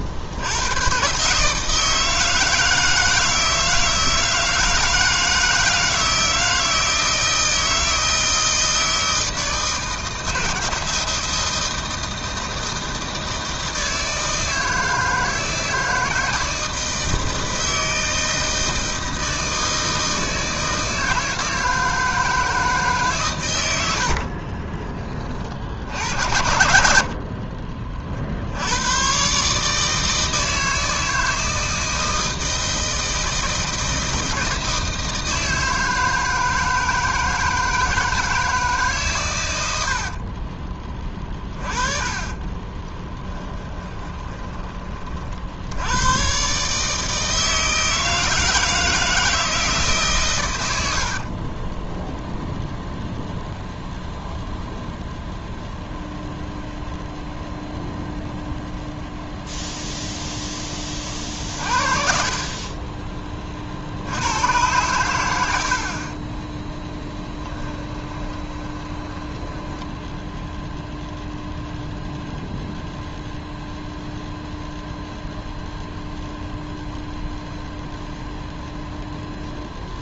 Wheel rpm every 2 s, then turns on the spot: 120, 160, 160, 160, 160, 160, 160, 160, 160, 160, 160, 140, 30, 70, 110, 160, 160, 160, 160, 150, 20, 10, 30, 150, 160, 70, 0, 0, 0, 0, 20, 30, 110, 10, 20, 0, 0, 0, 0, 0.
26-28 40-44 62-64 66-70